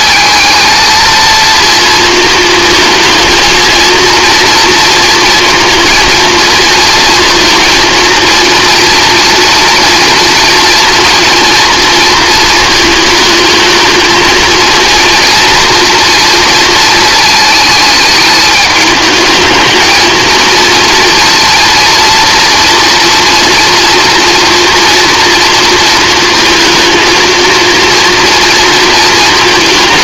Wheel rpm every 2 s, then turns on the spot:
220, 230, 230, 230, 230, 230, 220, 220, 230, 220, 230, 230, 230, 230, 230.
none